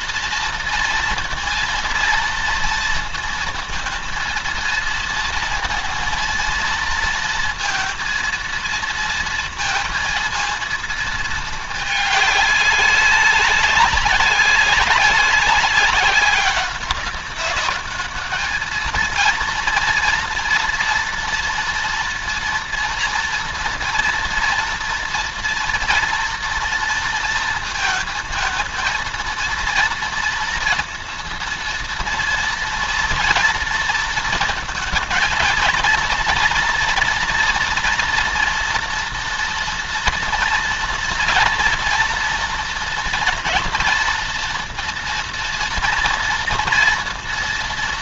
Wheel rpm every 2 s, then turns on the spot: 230, 230, 230, 230, 230, 230, 200, 200, 190, 220, 240, 230, 230, 230, 230, 230, 230, 220, 230, 230, 230, 230, 230, 230.
none